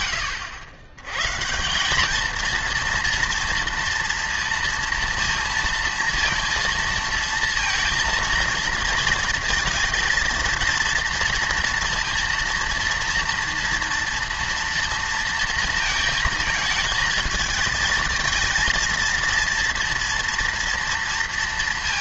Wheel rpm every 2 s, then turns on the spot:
90, 230, 230, 230, 230, 230, 230, 230, 220, 230, 230.
none